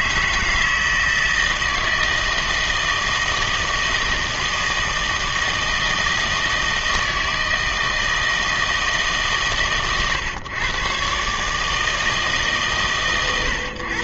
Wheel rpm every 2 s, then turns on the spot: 160, 160, 160, 160, 160, 120, 140.
none